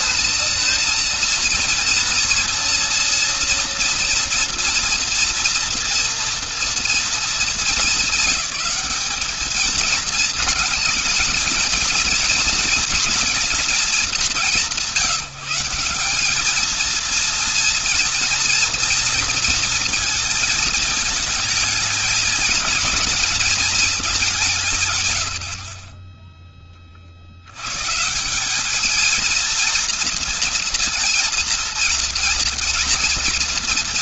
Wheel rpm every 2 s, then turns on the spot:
230, 240, 240, 230, 200, 230, 230, 160, 210, 230, 220, 210, 170, 20, 200, 230, 230.
none